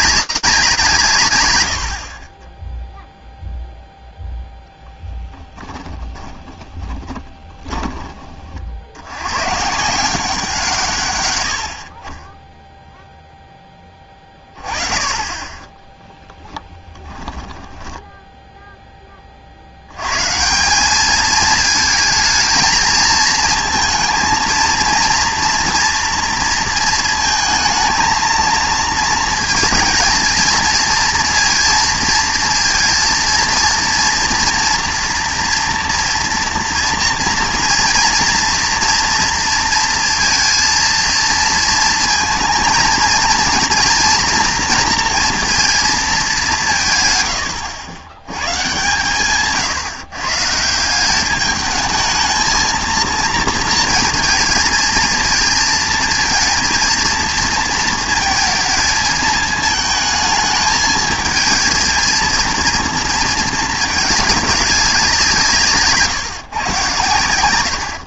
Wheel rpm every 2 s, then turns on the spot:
180, 10, 10, 20, 50, 150, 0, 20, 30, 10, 190, 230, 230, 230, 230, 230, 230, 230, 230, 230, 230, 230, 230, 150, 130, 160, 220, 220, 230, 220, 220, 230, 200, 120.
6-8 16-18